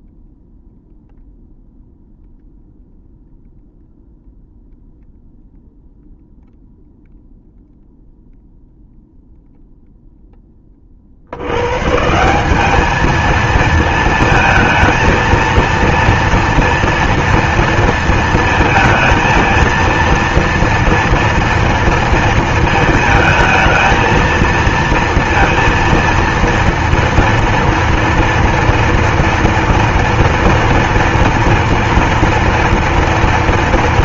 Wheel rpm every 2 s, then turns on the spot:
0, 0, 0, 0, 0, 20, 190, 220, 230, 220, 230, 220, 230, 230, 230, 230, 230.
none